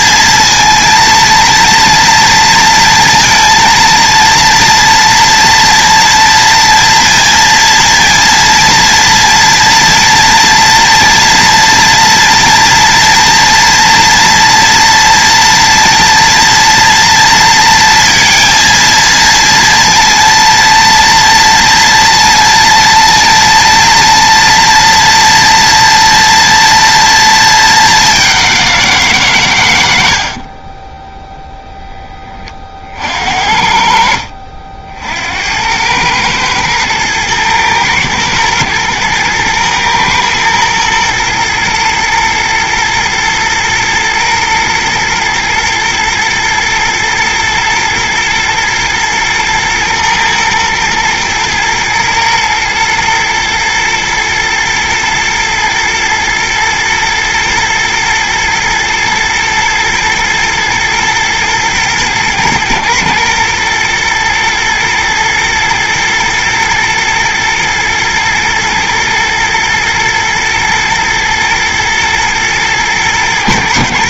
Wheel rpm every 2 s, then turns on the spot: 230, 230, 230, 230, 240, 230, 230, 230, 230, 230, 230, 230, 230, 230, 160, 10, 60, 80, 110, 110, 120, 120, 120, 120, 120, 110, 120, 120, 120, 110, 120, 120, 120, 120, 110, 110, 110.
none